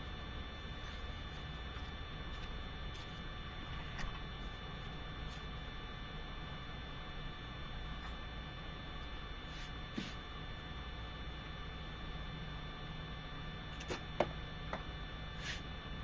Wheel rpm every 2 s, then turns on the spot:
0, 0, 0, 0, 0, 0, 0, 0.
none